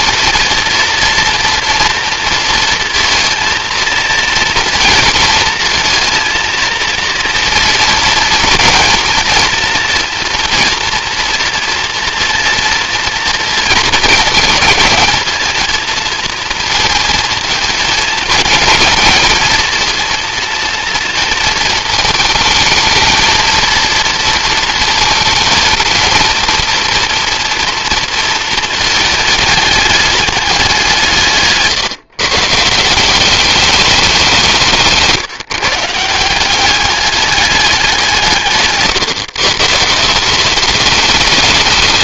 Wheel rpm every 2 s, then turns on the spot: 230, 230, 230, 230, 230, 230, 230, 230, 220, 220, 230, 220, 230, 230, 220, 180, 150, 170, 190, 150, 200.
38-40